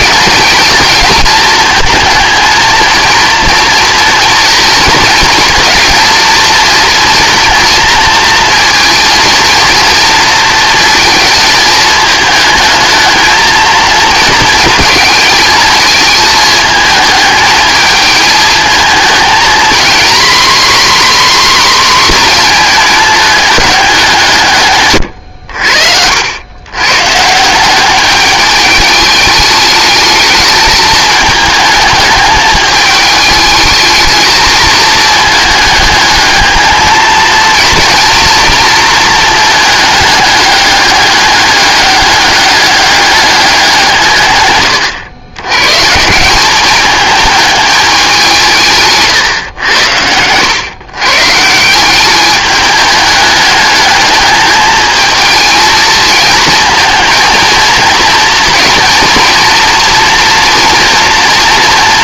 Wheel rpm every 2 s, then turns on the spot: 210, 220, 230, 230, 230, 220, 220, 230, 220, 220, 270, 230, 140, 110, 210, 220, 210, 220, 220, 230, 200, 200, 110, 200, 160, 110, 210, 220, 230, 230, 230.
none